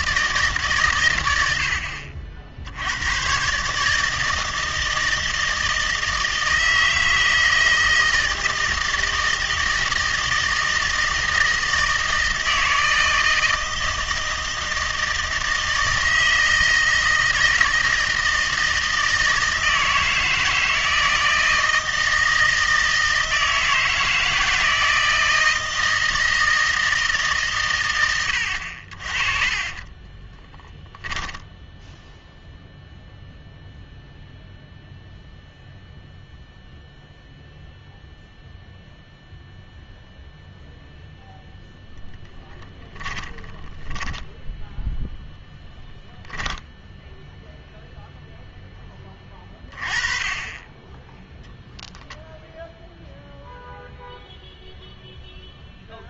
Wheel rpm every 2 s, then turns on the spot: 140, 80, 160, 160, 160, 160, 160, 160, 160, 160, 160, 160, 160, 160, 60, 20, 0, 0, 0, 0, 0, 10, 0, 0, 10, 20, 0, 0.
28-30 42-44